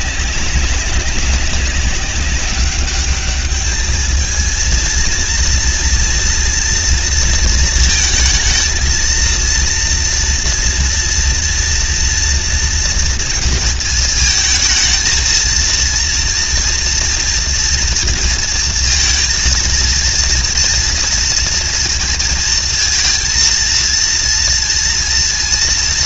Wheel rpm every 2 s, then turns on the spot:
190, 200, 230, 230, 230, 230, 230, 230, 230, 230, 230, 230, 230.
none